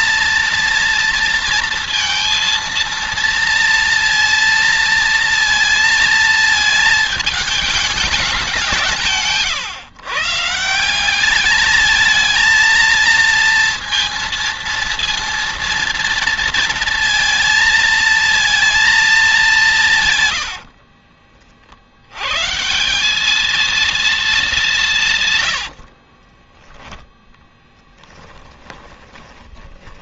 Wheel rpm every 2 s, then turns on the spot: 230, 230, 230, 220, 170, 180, 230, 230, 230, 220, 50, 180, 180, 10, 30.
20-22 28-30